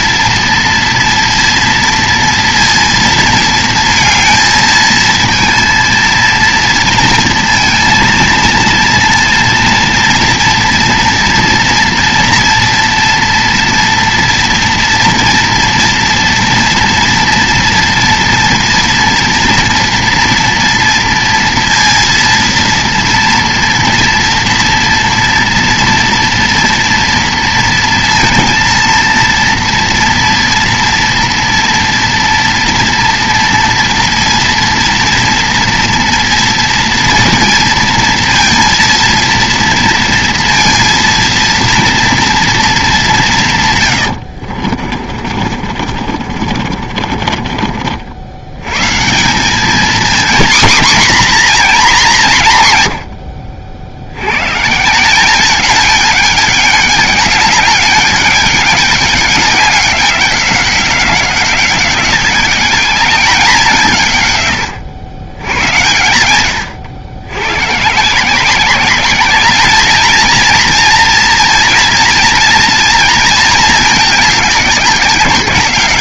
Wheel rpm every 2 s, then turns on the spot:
230, 230, 220, 230, 230, 230, 230, 230, 230, 230, 230, 230, 230, 230, 230, 230, 230, 230, 230, 230, 230, 230, 70, 50, 100, 240, 170, 110, 210, 200, 190, 200, 110, 100, 180, 230, 240, 210.
44-48